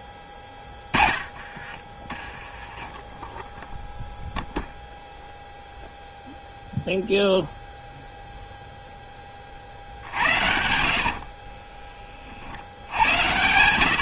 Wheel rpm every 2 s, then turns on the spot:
30, 20, 0, 0, 0, 80, 50.
0-2 10-12